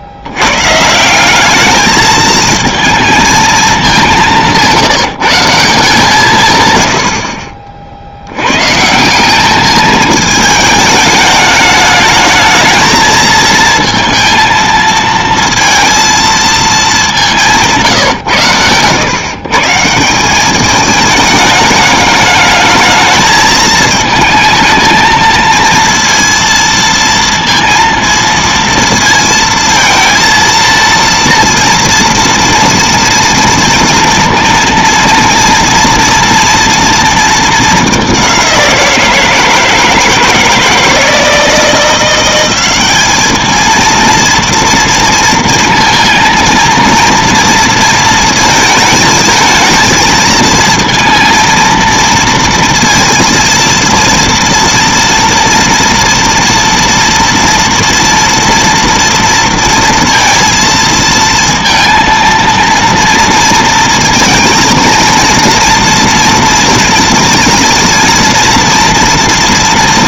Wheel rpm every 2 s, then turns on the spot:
130, 220, 160, 110, 130, 210, 220, 230, 210, 120, 210, 220, 220, 230, 230, 230, 230, 230, 230, 180, 170, 200, 230, 230, 230, 230, 230, 230, 230, 230, 230, 230, 230, 230, 230.
none